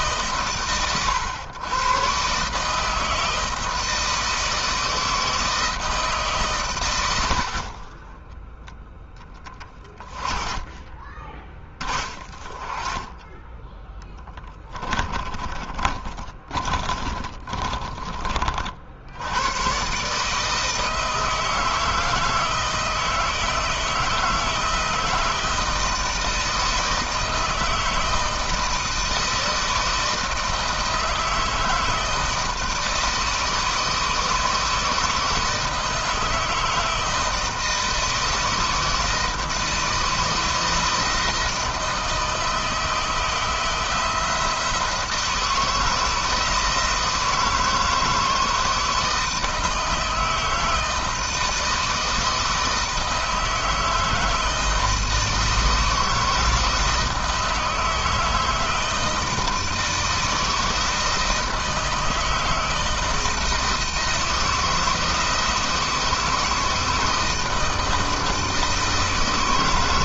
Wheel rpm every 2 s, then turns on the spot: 110, 160, 160, 80, 30, 20, 20, 20, 20, 80, 160, 160, 160, 160, 160, 160, 160, 160, 160, 160, 160, 160, 170, 160, 160, 160, 160, 160, 160, 160, 160, 160, 160, 160, 160.
10-12 14-18